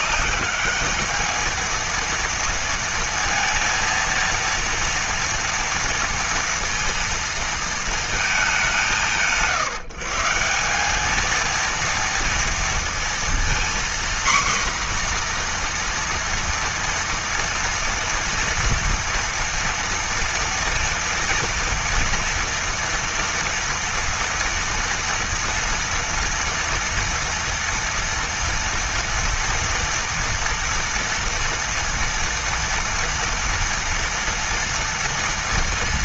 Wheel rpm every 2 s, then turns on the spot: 210, 230, 230, 230, 170, 190, 230, 250, 230, 230, 230, 230, 240, 230, 230, 230, 230, 230.
none